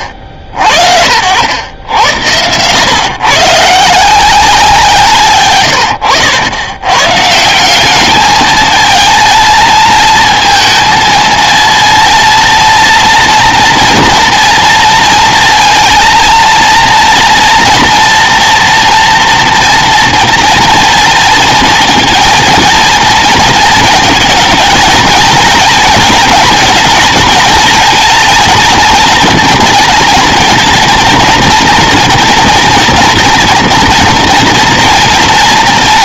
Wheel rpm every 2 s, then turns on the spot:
70, 120, 170, 90, 220, 220, 230, 230, 230, 230, 230, 230, 220, 230, 230, 220, 230, 230.
none